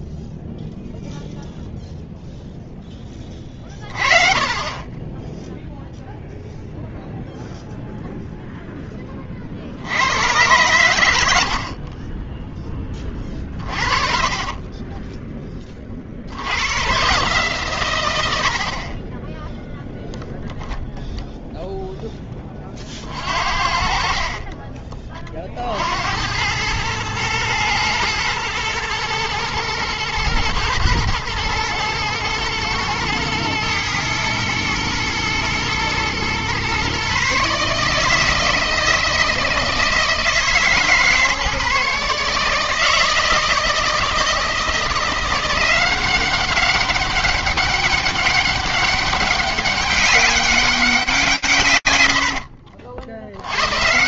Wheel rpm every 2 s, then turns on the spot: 0, 40, 0, 0, 50, 60, 30, 20, 130, 0, 0, 50, 30, 110, 110, 110, 110, 120, 140, 160, 140, 160, 170, 200, 200, 140, 110.
12-14